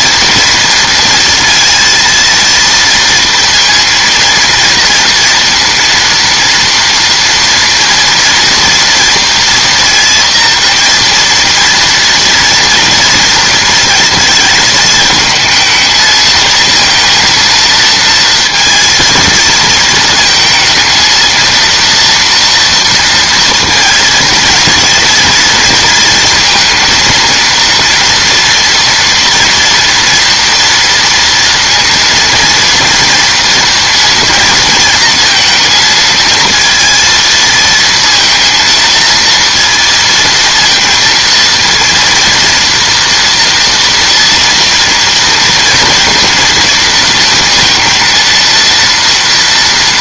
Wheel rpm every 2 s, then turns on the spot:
230, 230, 230, 240, 240, 230, 230, 220, 220, 230, 230, 240, 230, 230, 230, 230, 230, 230, 230, 230, 230, 230, 230, 230, 230.
none